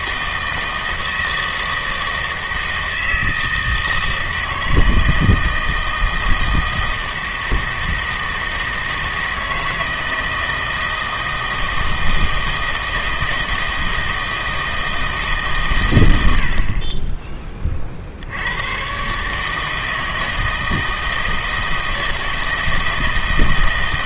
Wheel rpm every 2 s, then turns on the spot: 160, 160, 160, 160, 160, 160, 160, 160, 40, 100, 160, 160.
none